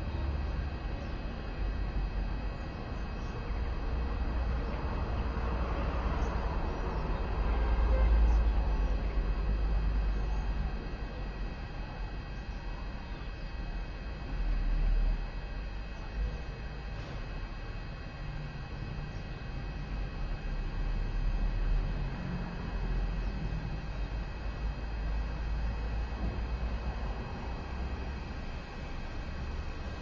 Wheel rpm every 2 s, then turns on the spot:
0, 0, 0, 0, 0, 0, 0, 0, 0, 0, 0, 0, 0, 0, 0.
none